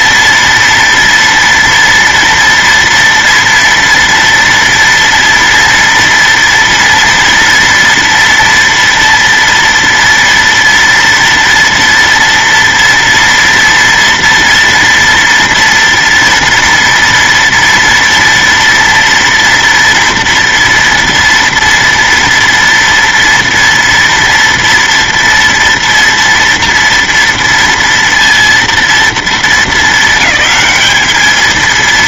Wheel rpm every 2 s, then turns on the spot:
230, 230, 230, 230, 230, 230, 230, 240, 230, 230, 230, 230, 230, 230, 230, 210.
none